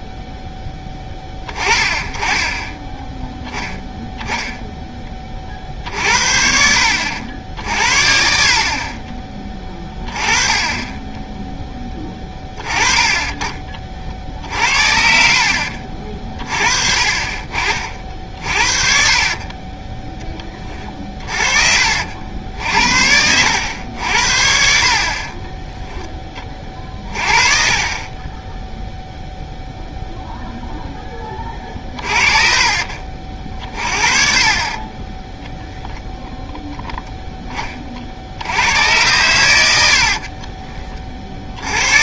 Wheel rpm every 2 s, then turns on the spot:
10, 20, 0, 60, 50, 20, 20, 60, 40, 40, 30, 70, 60, 30, 10, 0, 40, 40, 0, 90, 40.
20-22 24-26 32-34 40-42